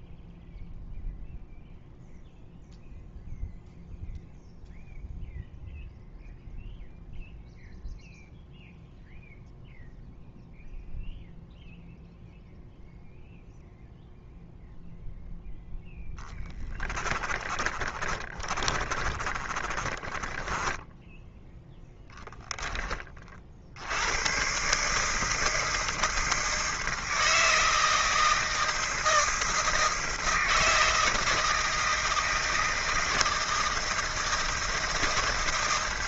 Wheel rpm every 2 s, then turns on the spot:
0, 0, 0, 0, 0, 0, 0, 0, 30, 30, 20, 10, 140, 160, 160, 160, 160, 160.
16-22